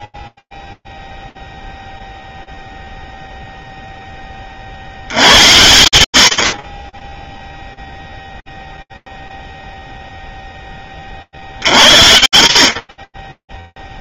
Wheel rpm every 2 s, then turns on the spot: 30, 0, 10, 80, 0, 20, 40.
none